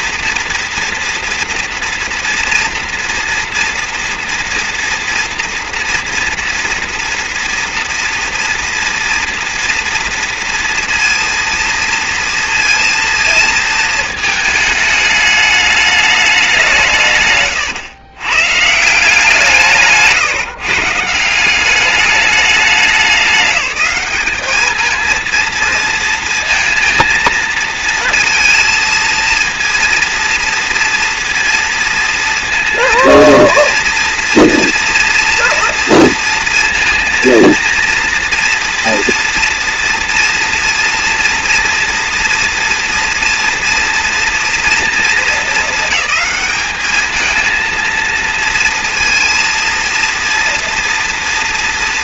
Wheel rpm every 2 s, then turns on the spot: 230, 230, 240, 240, 240, 230, 230, 220, 200, 120, 150, 210, 210, 230, 230, 230, 230, 230, 230, 230, 240, 230, 230, 200, 230, 230.
none